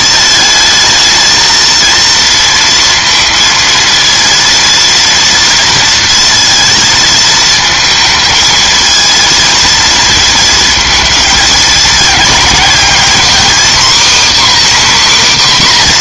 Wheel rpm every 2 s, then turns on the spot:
220, 230, 230, 230, 220, 220, 240, 290.
none